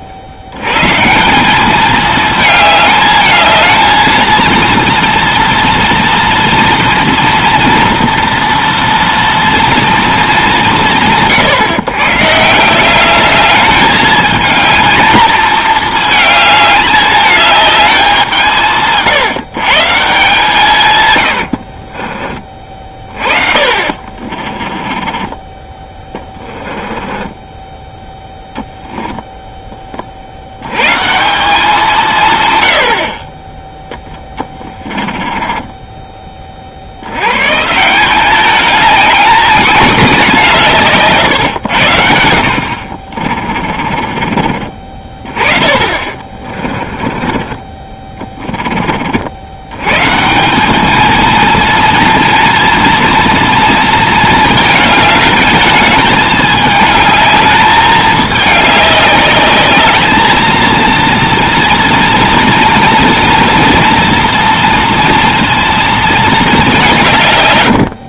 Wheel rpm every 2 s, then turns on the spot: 80, 220, 230, 230, 230, 130, 170, 220, 220, 160, 130, 30, 20, 20, 0, 110, 90, 30, 50, 210, 170, 60, 30, 30, 20, 190, 230, 220, 210, 210, 230, 230, 230, 190.
24-28 34-36 42-44 46-48